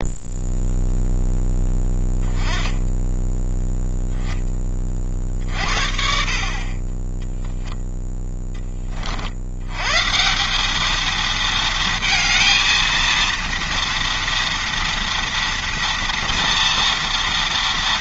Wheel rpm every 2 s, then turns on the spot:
0, 10, 30, 20, 30, 220, 230, 230, 230.
none